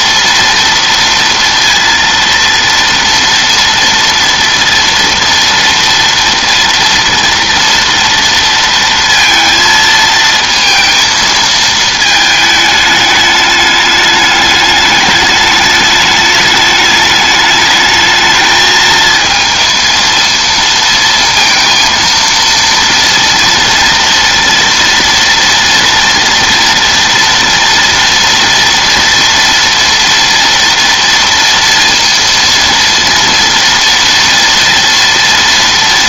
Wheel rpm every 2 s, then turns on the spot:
230, 230, 230, 230, 230, 230, 210, 210, 210, 220, 230, 230, 230, 230, 230, 230, 230, 230.
none